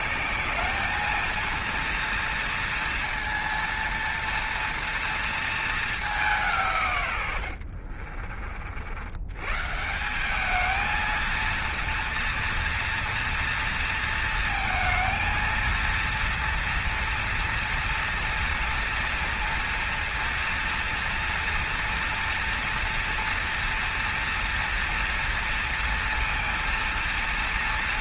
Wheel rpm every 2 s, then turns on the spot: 220, 230, 230, 130, 70, 220, 230, 220, 230, 230, 230, 230, 230, 230.
none